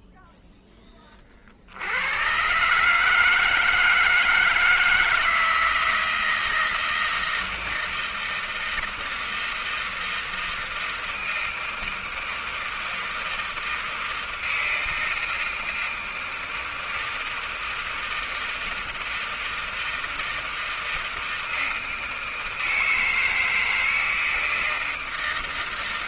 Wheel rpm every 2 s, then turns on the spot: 0, 90, 160, 160, 160, 160, 160, 160, 160, 160, 160, 160, 160.
none